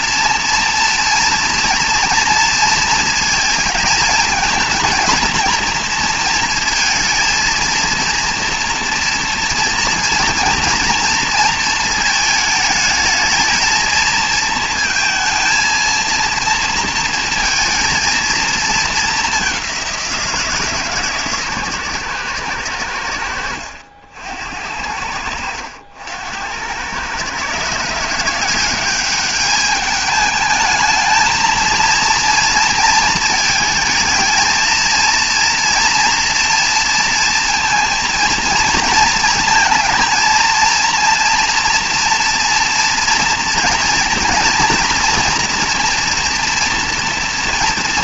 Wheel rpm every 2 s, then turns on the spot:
240, 230, 220, 230, 230, 230, 220, 230, 230, 220, 160, 100, 80, 90, 180, 220, 230, 230, 230, 230, 230, 230, 230, 230.
none